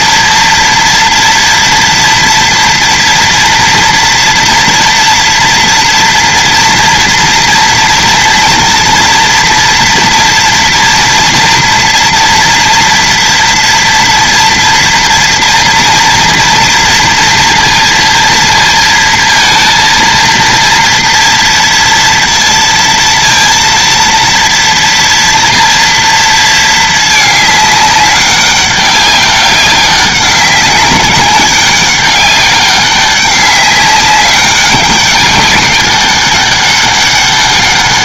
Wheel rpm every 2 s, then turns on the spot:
230, 230, 240, 240, 230, 230, 230, 230, 230, 230, 230, 230, 230, 220, 200, 190, 200, 200, 200.
none